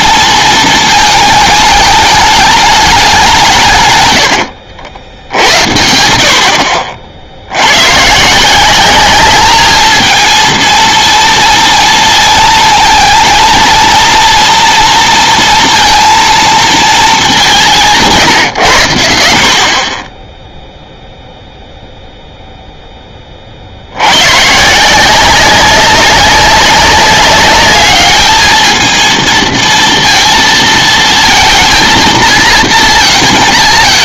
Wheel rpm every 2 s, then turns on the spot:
220, 210, 80, 50, 180, 220, 230, 230, 230, 120, 0, 0, 140, 200, 220, 230, 230.
4-6